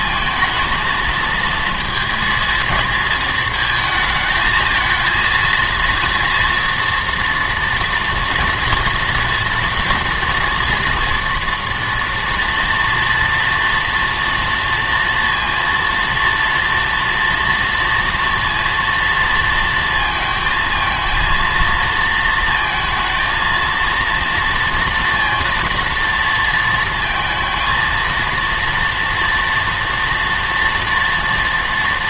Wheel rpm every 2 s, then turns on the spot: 230, 230, 220, 230, 230, 230, 230, 230, 230, 230, 220, 230, 230, 230, 230, 230.
none